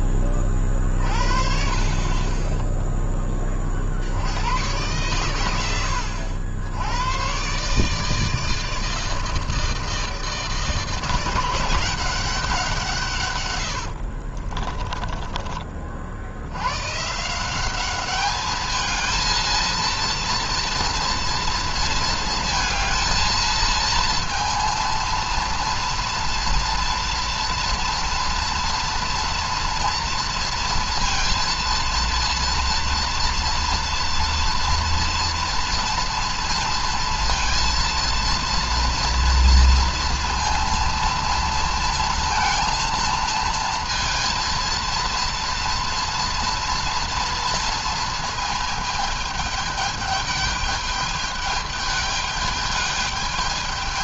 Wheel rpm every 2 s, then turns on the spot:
40, 10, 100, 100, 160, 160, 150, 30, 140, 220, 230, 220, 230, 230, 230, 230, 230, 230, 230, 230, 230, 230, 230, 240, 220, 210, 210.
14-16